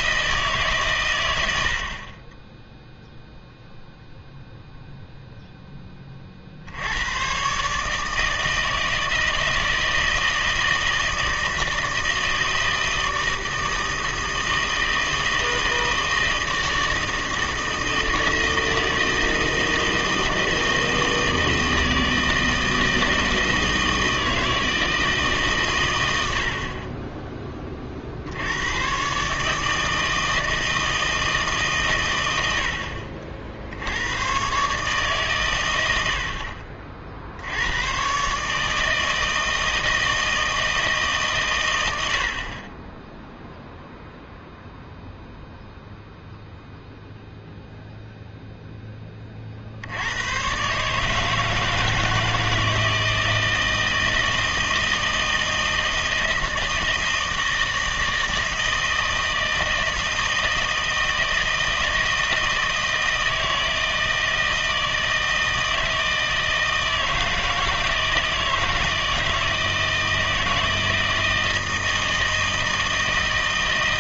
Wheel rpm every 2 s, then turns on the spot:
140, 10, 0, 70, 160, 160, 160, 160, 160, 160, 160, 160, 160, 50, 100, 160, 70, 140, 50, 150, 160, 30, 0, 0, 0, 130, 160, 160, 160, 160, 160, 160, 160, 160, 160, 160, 160.
none